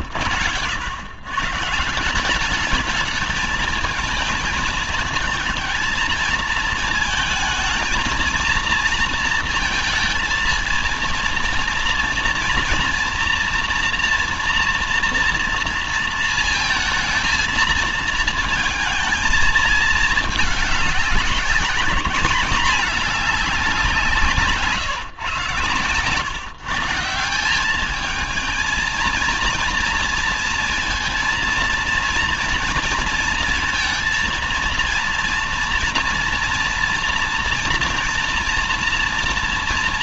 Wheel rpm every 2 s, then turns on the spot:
100, 210, 220, 220, 230, 230, 240, 240, 230, 220, 200, 200, 150, 140, 220, 230, 230, 230, 240, 230.
none